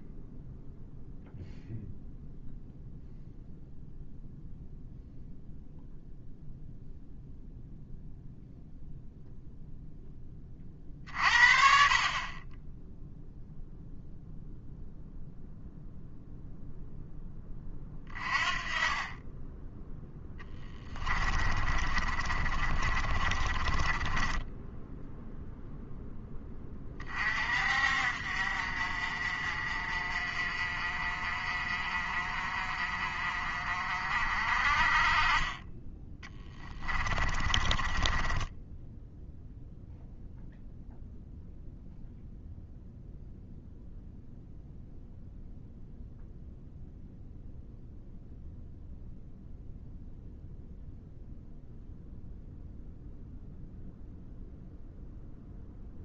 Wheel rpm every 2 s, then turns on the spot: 0, 0, 0, 0, 0, 40, 0, 0, 0, 30, 20, 30, 10, 30, 50, 40, 40, 30, 20, 10, 0, 0, 0, 0, 0, 0, 0, 0.
20-24 36-40